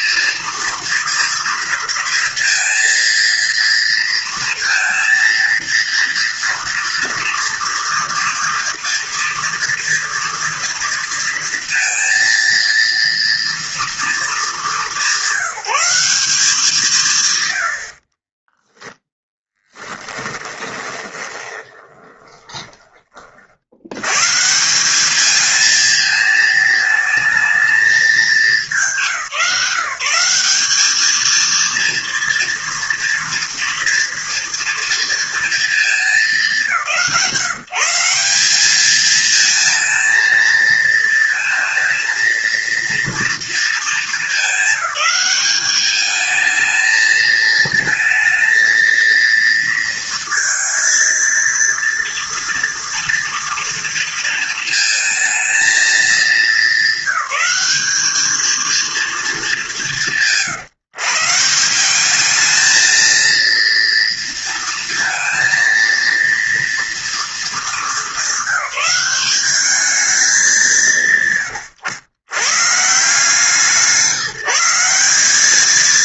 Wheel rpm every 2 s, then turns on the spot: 230, 230, 230, 230, 230, 230, 230, 210, 180, 10, 20, 20, 160, 220, 210, 200, 230, 230, 190, 200, 230, 230, 200, 220, 230, 230, 230, 230, 220, 230, 150, 220, 230, 230, 190, 200, 130, 170.
18-24